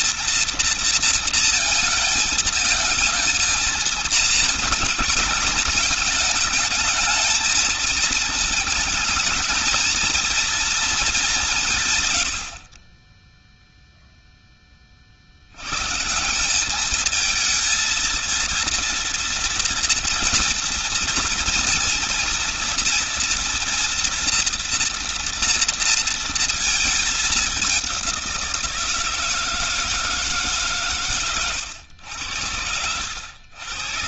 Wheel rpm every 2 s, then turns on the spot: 230, 220, 220, 220, 210, 210, 40, 30, 200, 230, 230, 230, 240, 220, 170, 140, 90.
none